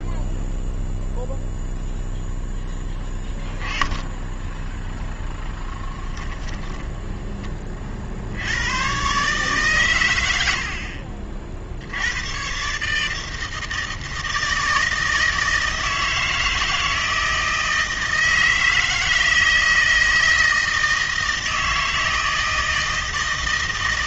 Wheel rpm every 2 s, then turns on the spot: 0, 10, 10, 10, 90, 70, 130, 160, 160, 160, 160, 160.
6-8